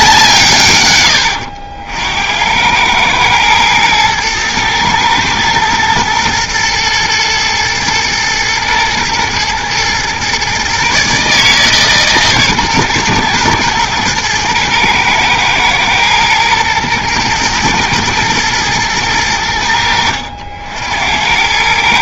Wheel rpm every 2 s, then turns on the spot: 120, 100, 110, 120, 120, 140, 120, 110, 110, 120, 70.
none